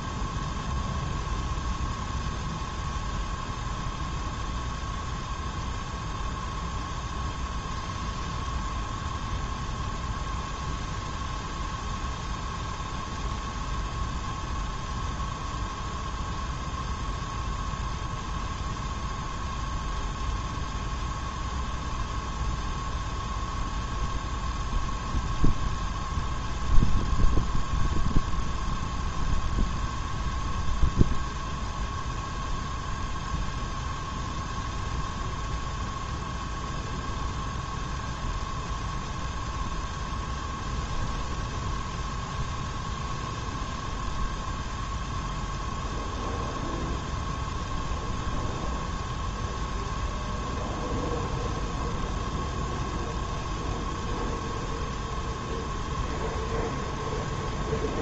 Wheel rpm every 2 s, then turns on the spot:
0, 0, 0, 0, 0, 0, 0, 0, 0, 0, 0, 0, 0, 0, 0, 0, 0, 0, 0, 0, 0, 0, 0, 0, 0, 0, 0, 0, 0.
none